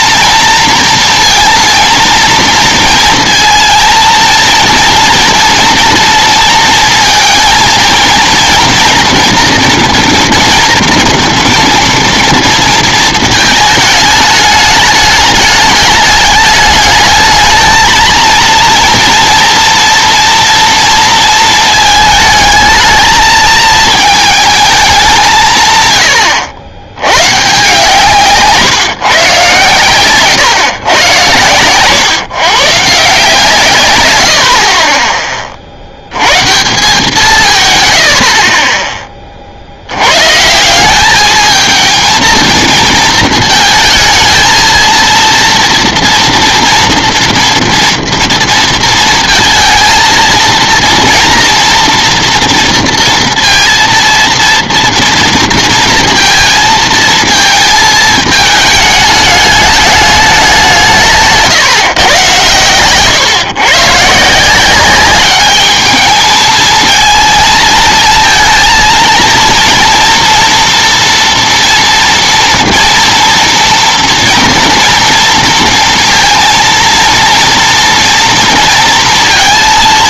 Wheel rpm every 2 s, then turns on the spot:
230, 230, 230, 230, 230, 230, 230, 210, 210, 230, 230, 220, 220, 100, 150, 130, 140, 50, 140, 40, 160, 230, 220, 230, 230, 230, 230, 230, 220, 210, 190, 120, 180, 220, 230, 230, 230, 230, 230, 230.
none